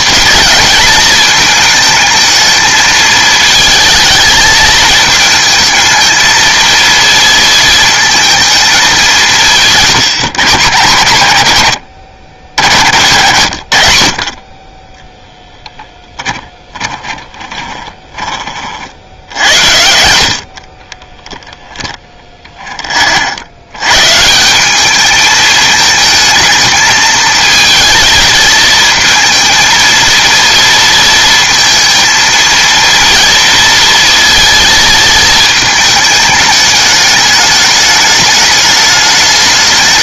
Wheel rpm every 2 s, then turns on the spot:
230, 220, 220, 230, 200, 120, 90, 10, 30, 60, 30, 20, 190, 220, 220, 230, 230, 220, 210, 210.
16-18 20-22